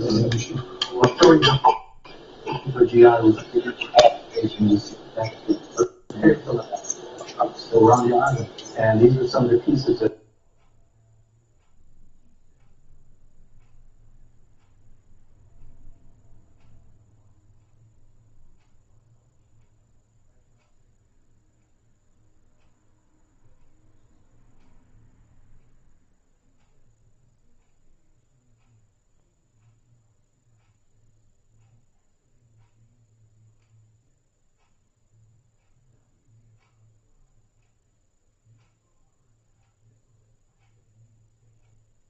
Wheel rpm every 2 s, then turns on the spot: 0, 0, 0, 0, 0, 0, 0, 0, 0, 0, 0, 0, 0, 0, 0, 0, 0, 0, 0, 0, 0.
none